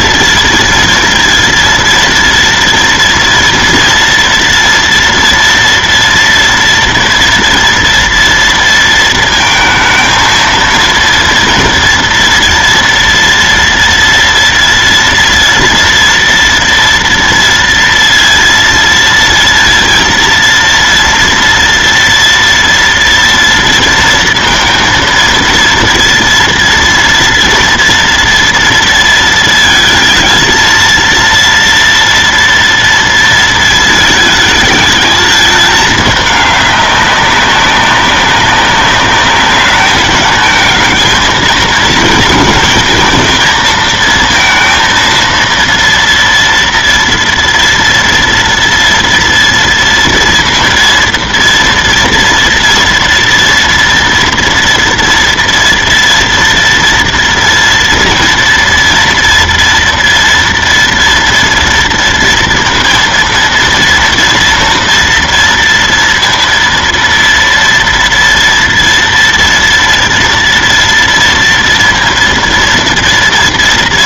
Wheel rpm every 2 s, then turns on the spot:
230, 230, 230, 230, 230, 230, 240, 230, 240, 230, 230, 230, 230, 230, 230, 230, 230, 220, 210, 200, 220, 220, 230, 230, 230, 230, 230, 230, 230, 230, 230, 230, 230, 230, 230, 230, 230.
none